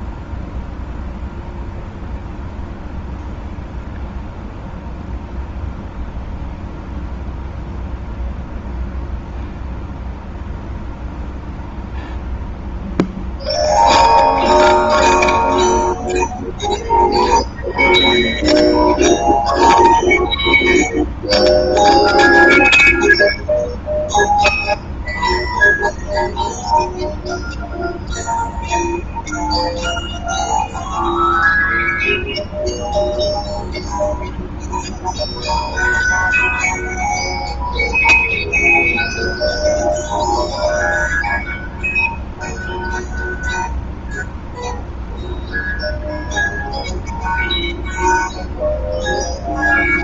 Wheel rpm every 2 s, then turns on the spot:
0, 0, 0, 0, 0, 0, 0, 0, 0, 0, 0, 0, 0, 0, 0, 0, 0, 0, 0, 0, 0, 0, 0, 0, 0.
none